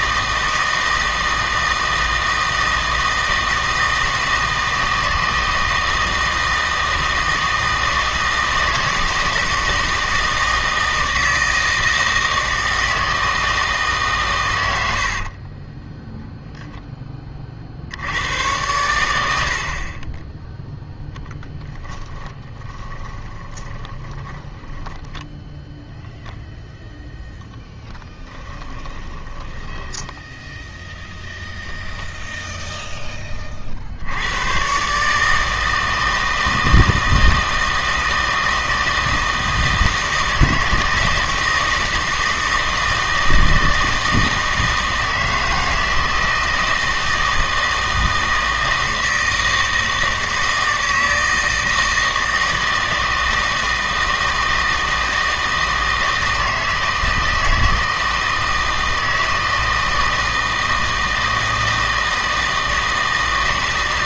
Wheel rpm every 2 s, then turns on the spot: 160, 160, 160, 160, 160, 160, 160, 90, 0, 100, 0, 20, 10, 10, 20, 0, 0, 120, 160, 160, 160, 160, 160, 160, 160, 160, 160, 160, 160, 160, 160, 160.
22-30